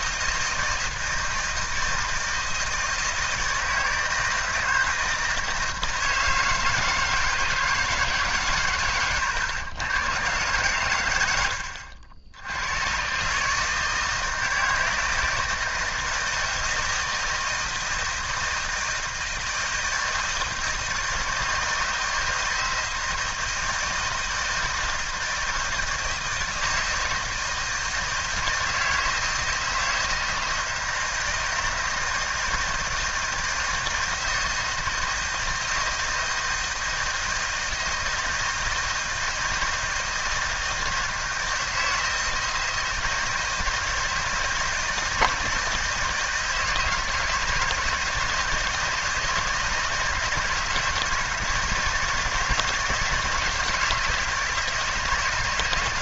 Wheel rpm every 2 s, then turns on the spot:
160, 160, 160, 160, 140, 130, 90, 160, 160, 160, 160, 160, 160, 160, 160, 160, 160, 160, 160, 160, 160, 170, 160, 160, 160, 160, 160, 160.
none